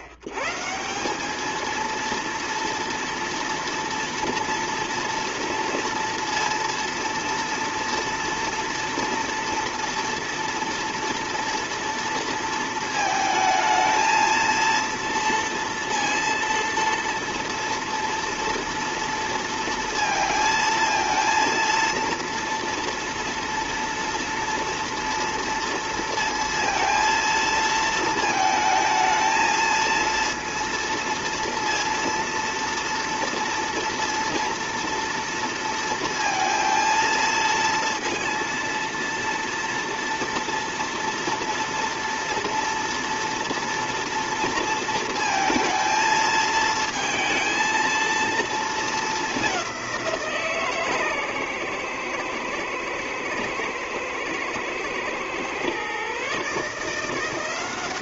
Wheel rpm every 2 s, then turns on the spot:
100, 230, 230, 230, 230, 230, 230, 230, 230, 230, 230, 230, 230, 230, 220, 230, 230, 230, 230, 230, 230, 230, 230, 220, 230, 160, 120, 110, 150.
none